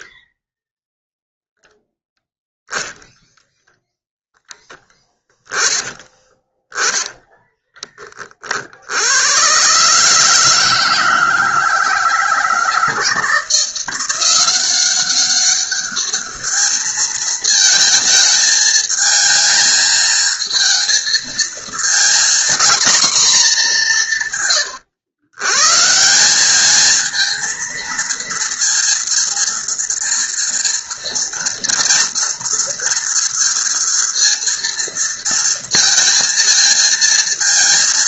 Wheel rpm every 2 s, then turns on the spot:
0, 0, 0, 20, 30, 160, 160, 180, 210, 220, 220, 230, 160, 180, 230, 230, 230, 230, 230.
6-8